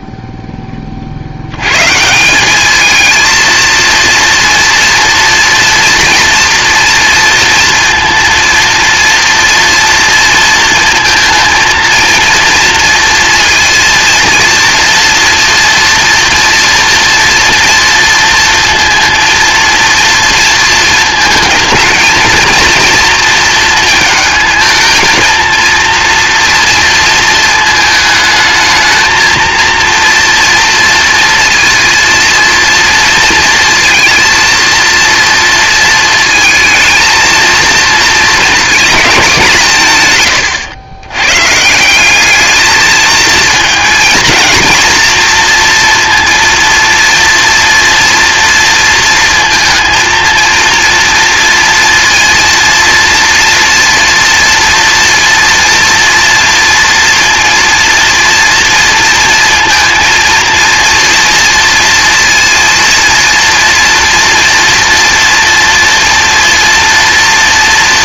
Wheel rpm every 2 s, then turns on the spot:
20, 210, 230, 230, 230, 220, 230, 230, 230, 230, 230, 230, 220, 230, 220, 230, 230, 230, 220, 220, 110, 220, 230, 230, 230, 230, 230, 230, 230, 230, 230, 230, 230, 230.
none